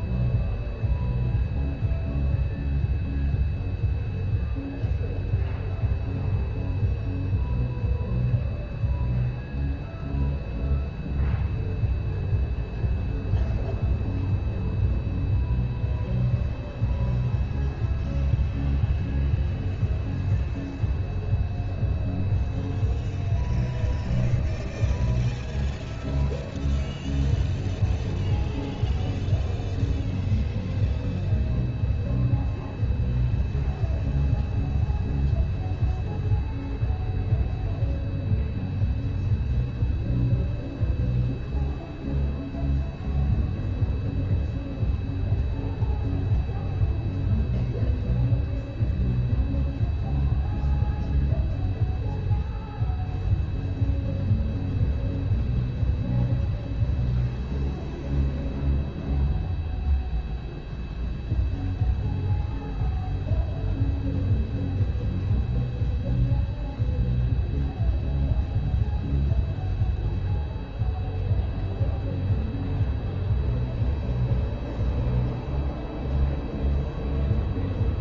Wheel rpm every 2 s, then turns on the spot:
0, 0, 0, 0, 0, 0, 0, 0, 0, 0, 0, 0, 0, 0, 0, 0, 0, 0, 0, 0, 0, 0, 0, 0, 0, 0, 0, 0, 0, 0, 0, 0, 0, 0, 0, 0, 0, 0, 0.
none